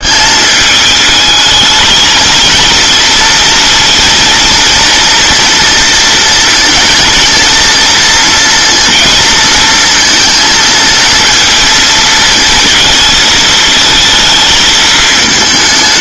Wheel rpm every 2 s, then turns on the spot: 210, 230, 230, 230, 230, 230, 230, 220.
none